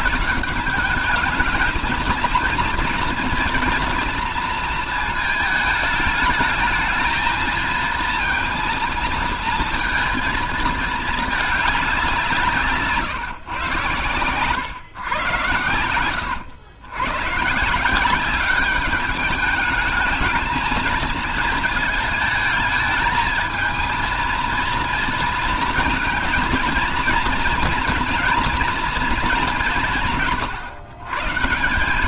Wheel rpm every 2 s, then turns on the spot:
210, 230, 230, 220, 230, 220, 170, 110, 110, 200, 220, 220, 230, 230, 230, 130.
none